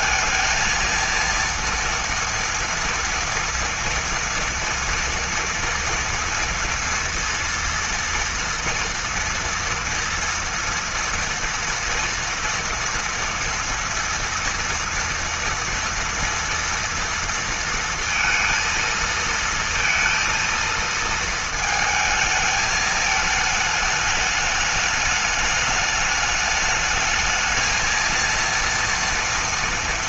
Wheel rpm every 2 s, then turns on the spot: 230, 230, 240, 230, 230, 230, 230, 230, 230, 230, 230, 220, 210, 210, 230.
none